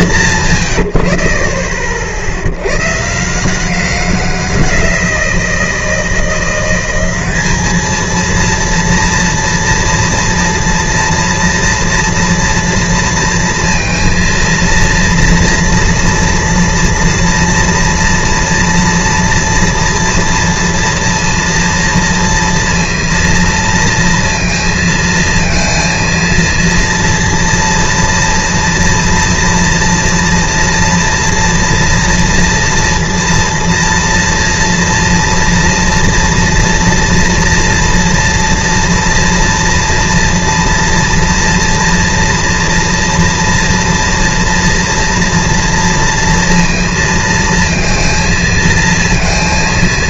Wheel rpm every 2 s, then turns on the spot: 120, 90, 180, 180, 230, 230, 230, 230, 230, 230, 230, 230, 230, 230, 230, 230, 230, 230, 230, 230, 240, 230, 230, 230, 220.
none